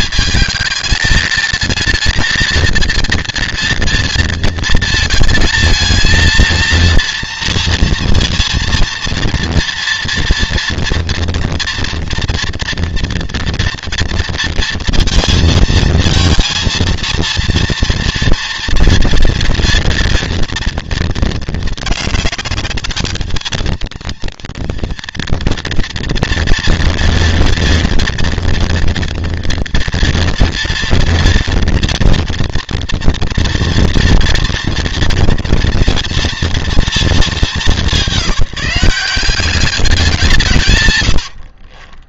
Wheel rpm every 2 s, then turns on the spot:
200, 230, 220, 230, 230, 230, 230, 230, 230, 230, 230, 210, 230, 230, 230, 230, 240, 230, 230, 190, 160.
none